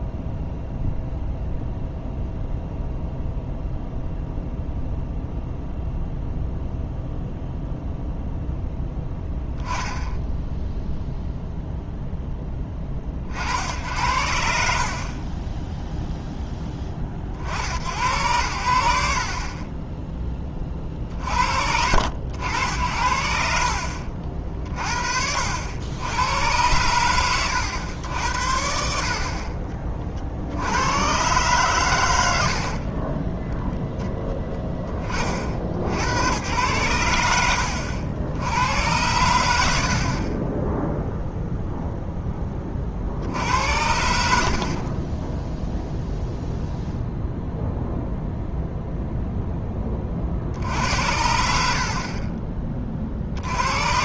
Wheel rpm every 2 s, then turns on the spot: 0, 0, 0, 0, 0, 0, 20, 40, 10, 80, 50, 80, 50, 100, 60, 90, 40, 10, 110, 80, 10, 20, 60, 0, 0, 70, 30.
24-26